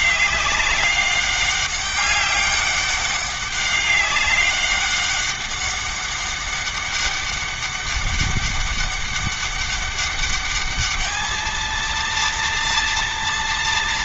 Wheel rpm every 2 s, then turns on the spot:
200, 200, 200, 200, 200, 210, 230.
none